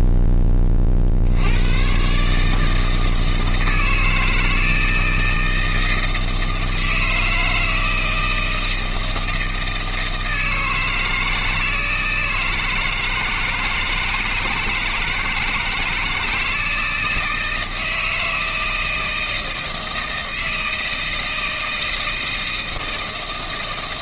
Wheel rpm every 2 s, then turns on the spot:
0, 80, 160, 160, 160, 160, 160, 160, 160, 160, 160, 160.
none